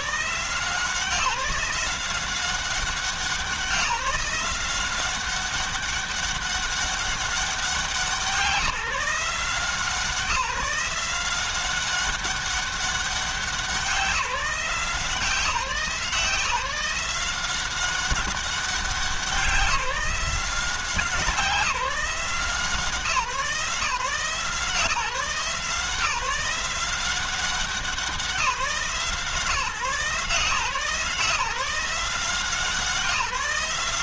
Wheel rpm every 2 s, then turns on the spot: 170, 180, 180, 200, 170, 180, 200, 170, 170, 190, 180, 160, 160, 170, 160, 160, 180.
none